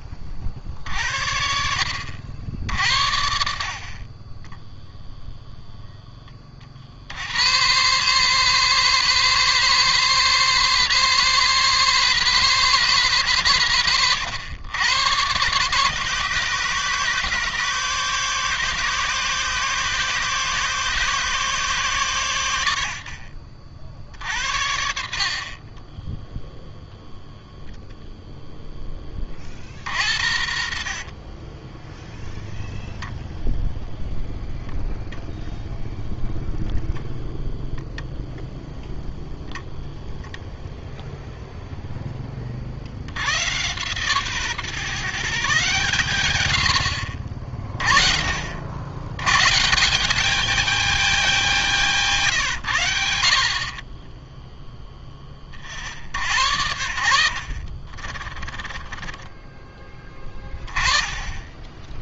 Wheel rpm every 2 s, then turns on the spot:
50, 70, 10, 60, 140, 140, 140, 110, 140, 140, 150, 70, 60, 0, 10, 50, 0, 0, 0, 0, 0, 70, 150, 80, 90, 210, 90, 10, 80, 20, 20.
4-6 30-32